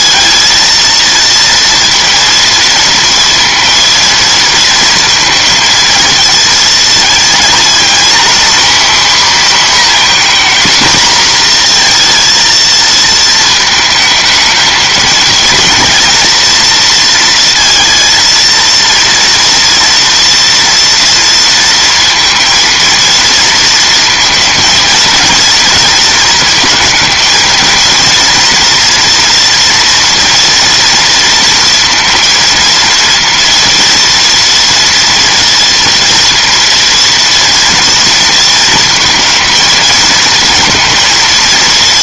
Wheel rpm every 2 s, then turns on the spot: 230, 230, 230, 230, 260, 240, 230, 220, 230, 230, 230, 230, 230, 230, 230, 230, 230, 230, 230, 220, 230.
none